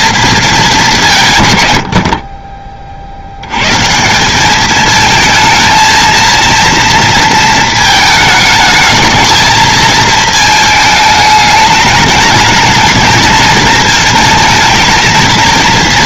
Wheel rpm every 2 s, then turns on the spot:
220, 40, 210, 230, 210, 220, 210, 220.
none